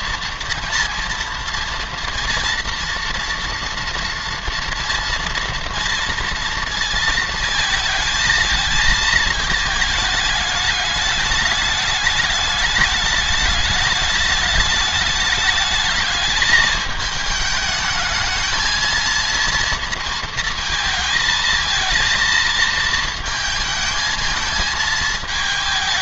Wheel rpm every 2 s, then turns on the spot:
230, 230, 230, 230, 220, 210, 210, 210, 210, 220, 220, 220, 220.
none